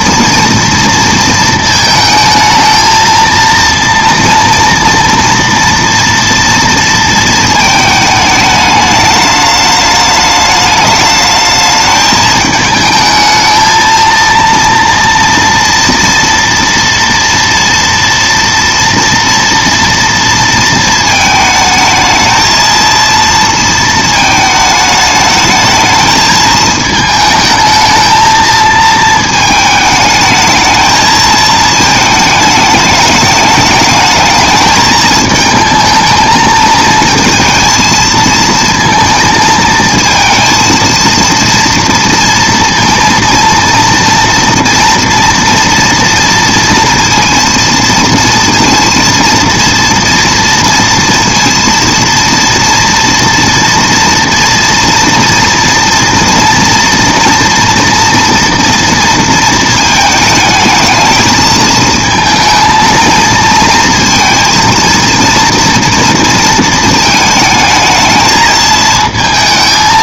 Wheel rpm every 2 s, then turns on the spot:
230, 220, 230, 230, 210, 210, 220, 230, 230, 230, 230, 230, 220, 220, 220, 220, 220, 220, 220, 230, 230, 230, 230, 230, 230, 230, 240, 230, 230, 230, 220, 230, 230, 230, 220.
none